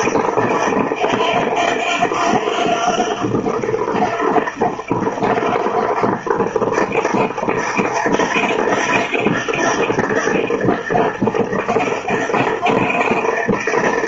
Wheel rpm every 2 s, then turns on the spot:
90, 90, 90, 90, 90, 90, 90.
none